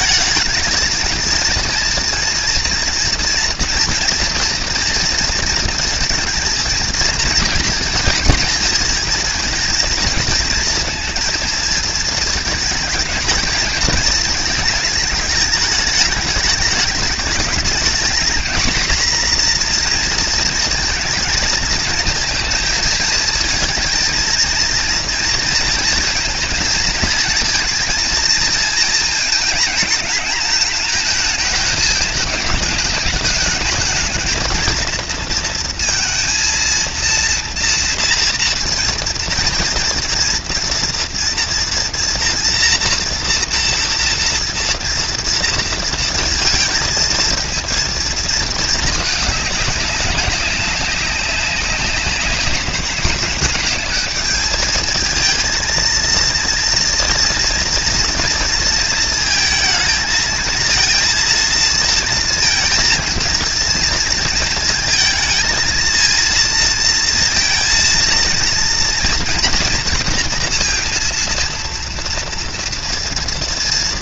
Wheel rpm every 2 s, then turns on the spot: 220, 240, 240, 230, 230, 230, 220, 220, 210, 240, 230, 220, 230, 230, 230, 220, 220, 230, 230, 230, 230, 230, 230, 230, 220, 190, 200, 220, 230, 230, 230, 230, 230, 230, 230, 230, 230.
none